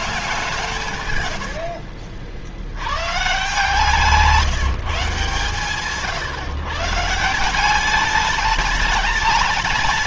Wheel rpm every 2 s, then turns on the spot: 140, 110, 160, 150, 210.
none